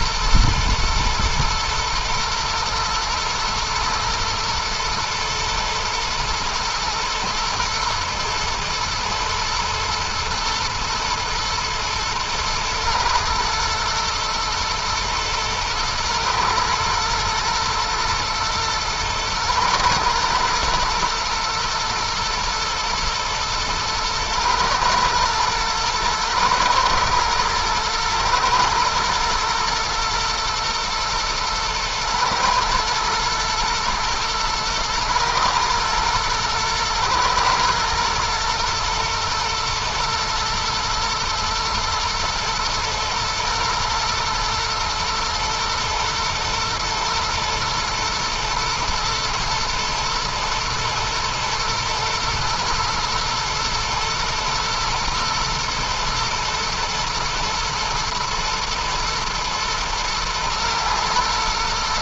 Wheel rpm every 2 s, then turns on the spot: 120, 110, 110, 120, 120, 120, 120, 120, 120, 120, 120, 110, 120, 110, 110, 120, 120, 110, 110, 120, 110, 120, 120, 110, 110, 120, 120, 120, 110, 110, 120.
none